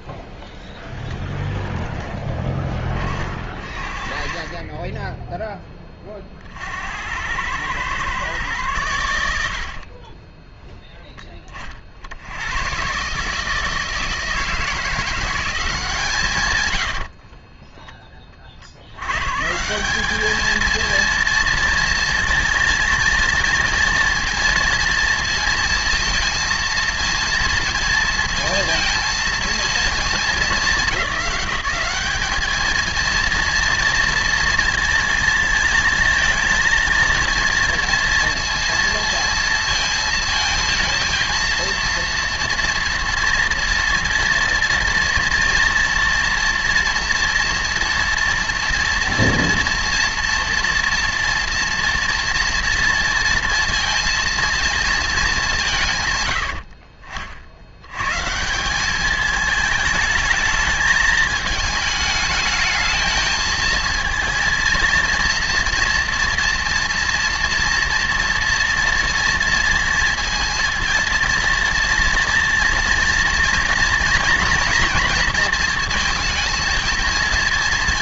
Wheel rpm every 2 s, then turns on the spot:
0, 20, 20, 60, 120, 10, 110, 170, 130, 50, 220, 230, 230, 230, 230, 210, 220, 230, 230, 230, 230, 230, 230, 230, 230, 230, 230, 230, 70, 170, 210, 220, 230, 230, 230, 230, 230, 230, 220.
16-18 56-58